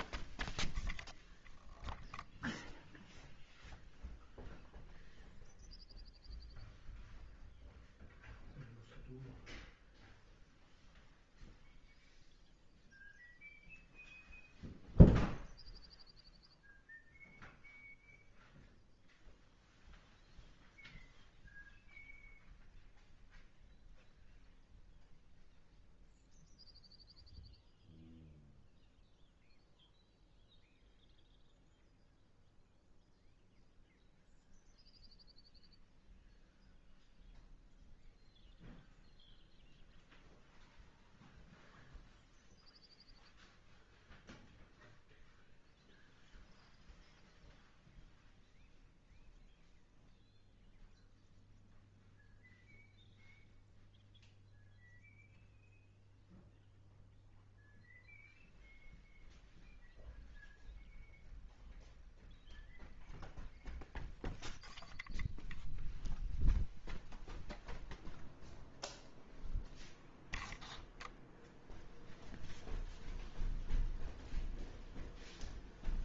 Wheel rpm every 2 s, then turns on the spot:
0, 0, 0, 0, 0, 0, 0, 0, 0, 0, 0, 0, 0, 0, 0, 0, 0, 0, 0, 0, 0, 0, 0, 0, 0, 0, 0, 0, 0, 0, 0, 0, 0, 0, 0, 0, 0, 0.
none